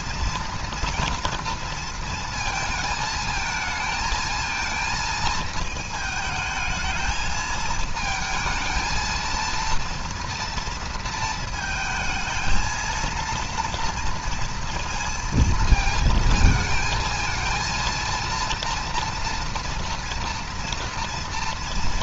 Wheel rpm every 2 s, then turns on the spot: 230, 220, 220, 220, 230, 230, 230, 230, 230, 230, 230.
none